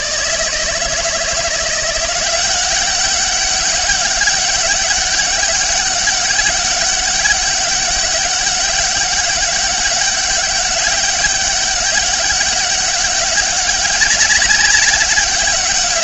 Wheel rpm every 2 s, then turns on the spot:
160, 190, 200, 200, 200, 200, 200, 200.
none